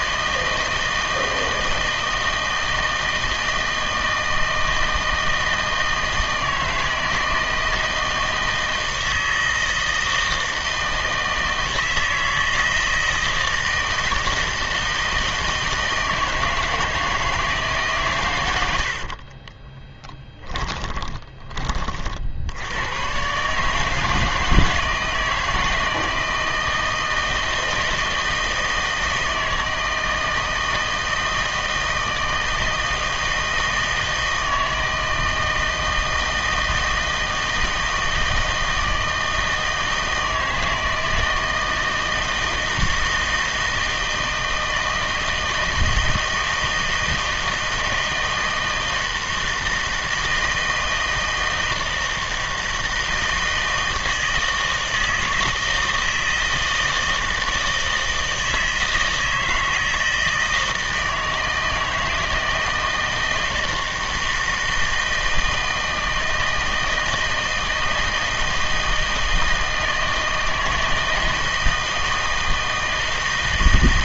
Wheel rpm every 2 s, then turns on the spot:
160, 160, 160, 160, 160, 160, 160, 160, 160, 100, 10, 90, 160, 160, 160, 160, 160, 160, 160, 160, 160, 160, 160, 160, 160, 160, 160, 160, 160, 160, 160, 160, 160, 160, 160, 160, 160.
20-22